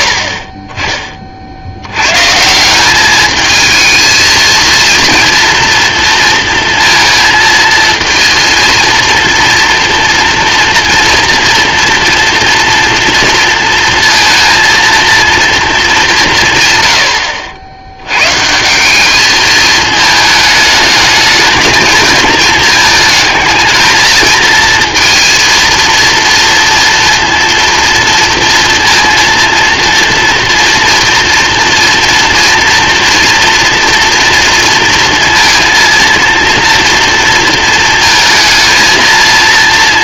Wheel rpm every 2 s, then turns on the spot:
30, 170, 230, 230, 230, 230, 240, 230, 120, 170, 220, 220, 230, 230, 230, 230, 240, 230, 240, 220.
none